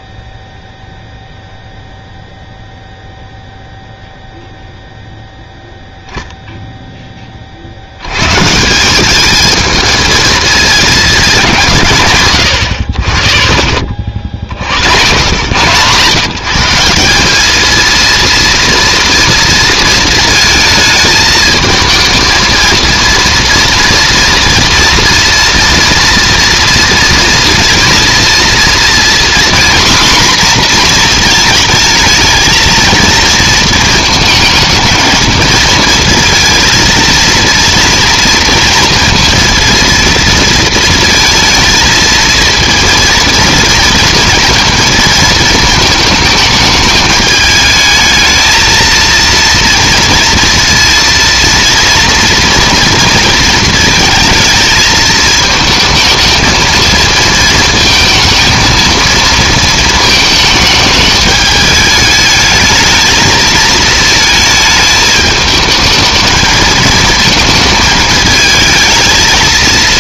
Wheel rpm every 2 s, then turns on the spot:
0, 0, 0, 0, 160, 220, 100, 70, 160, 230, 220, 230, 230, 230, 230, 240, 220, 220, 230, 230, 230, 230, 230, 210, 220, 230, 230, 220, 220, 230, 220, 220, 220, 220, 220.
none